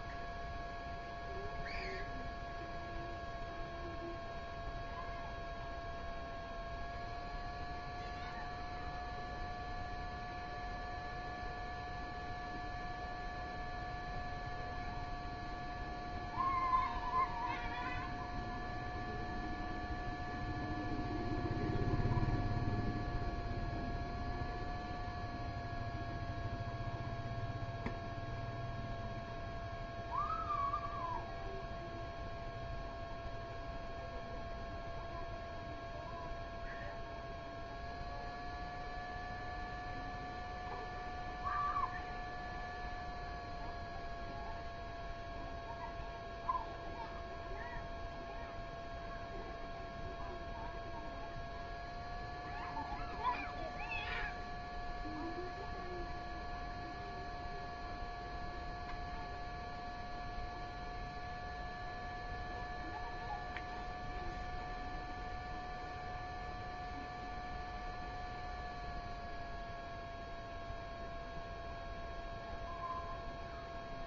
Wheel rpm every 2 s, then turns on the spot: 0, 0, 0, 0, 0, 0, 0, 0, 0, 0, 0, 0, 0, 0, 0, 0, 0, 0, 0, 0, 0, 0, 0, 0, 0, 0, 0, 0, 0, 0, 0, 0, 0, 0, 0, 0, 0.
none